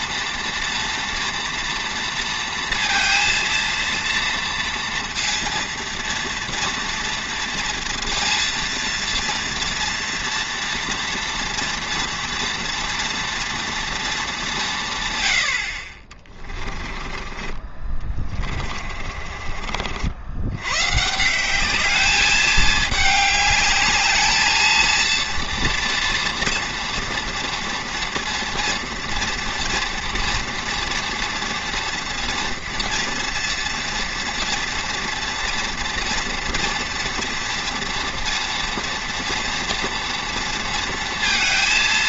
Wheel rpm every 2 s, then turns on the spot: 230, 230, 230, 240, 230, 230, 230, 180, 20, 30, 100, 210, 220, 230, 230, 230, 230, 230, 230, 230, 230.
16-20